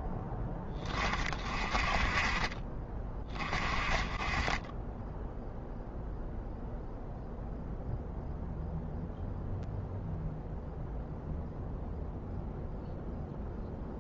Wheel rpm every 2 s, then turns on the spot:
20, 10, 0, 0, 0, 0, 0.
none